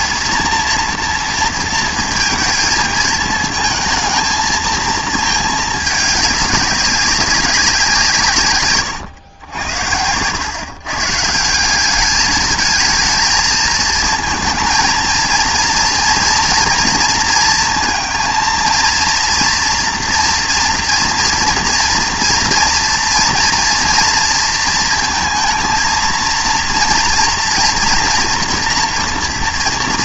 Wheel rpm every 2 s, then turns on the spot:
230, 220, 220, 200, 110, 130, 220, 230, 230, 230, 230, 230, 230, 230, 230.
none